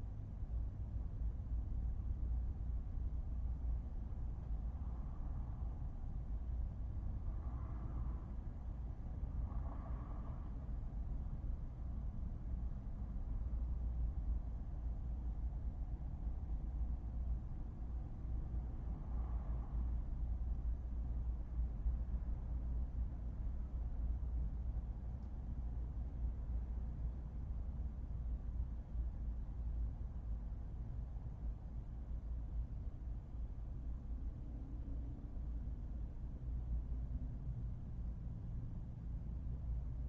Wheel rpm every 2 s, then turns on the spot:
0, 0, 0, 0, 0, 0, 0, 0, 0, 0, 0, 0, 0, 0, 0, 0, 0, 0, 0, 0.
none